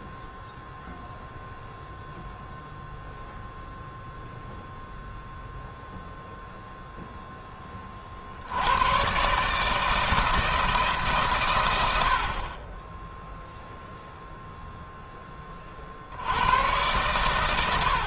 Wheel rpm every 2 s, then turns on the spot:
0, 0, 0, 0, 90, 160, 30, 0, 110.
none